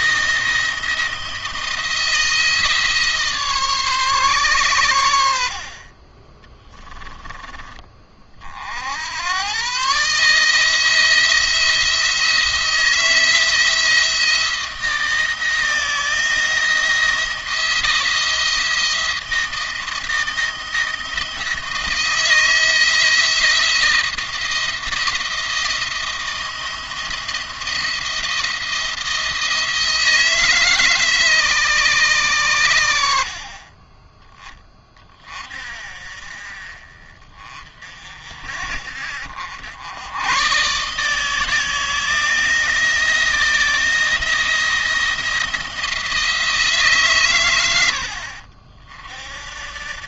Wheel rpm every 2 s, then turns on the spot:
170, 160, 110, 20, 70, 160, 160, 160, 170, 160, 160, 170, 170, 170, 170, 150, 90, 20, 40, 60, 140, 170, 170, 150, 50.
6-8